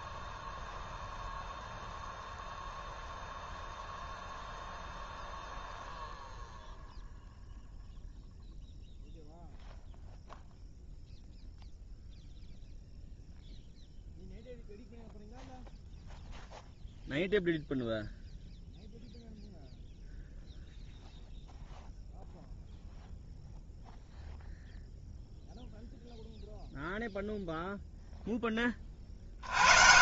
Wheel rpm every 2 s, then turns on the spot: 0, 0, 0, 0, 0, 0, 0, 0, 0, 0, 0, 0, 0, 0, 20.
none